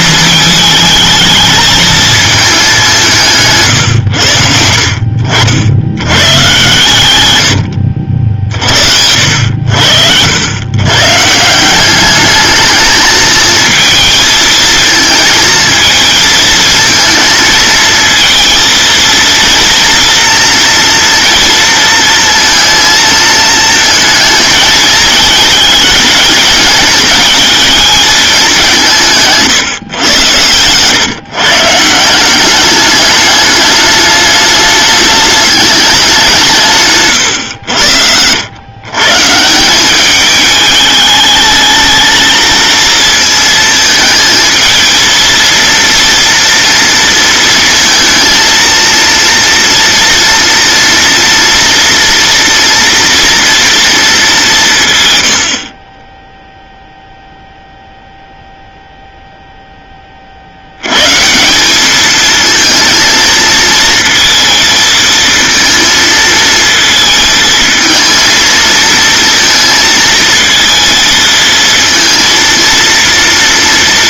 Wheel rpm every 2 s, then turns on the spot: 220, 200, 60, 120, 60, 110, 220, 220, 230, 230, 230, 230, 220, 220, 180, 110, 200, 210, 150, 120, 210, 230, 220, 230, 230, 230, 230, 190, 0, 0, 90, 230, 230, 220, 230, 220, 230.
none